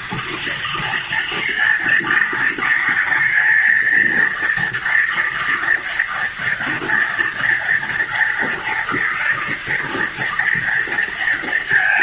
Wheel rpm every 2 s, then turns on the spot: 230, 230, 230, 240, 230, 230.
none